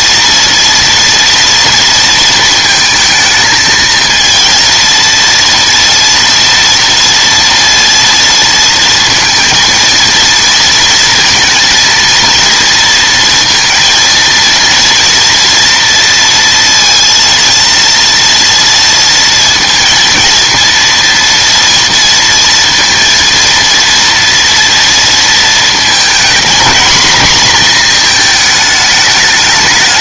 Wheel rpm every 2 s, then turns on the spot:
240, 220, 230, 230, 230, 230, 230, 230, 230, 230, 230, 230, 230, 230, 220.
none